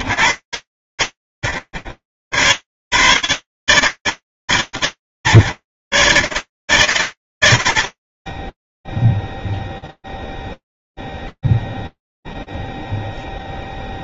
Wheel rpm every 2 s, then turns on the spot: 80, 130, 130, 70, 0, 0, 0.
none